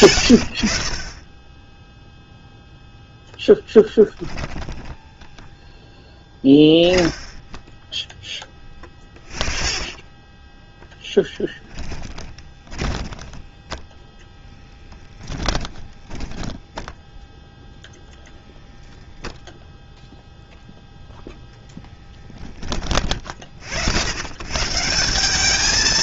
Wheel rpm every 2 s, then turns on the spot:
40, 0, 10, 10, 20, 0, 20, 10, 10, 0, 0, 30, 160.
8-10 12-16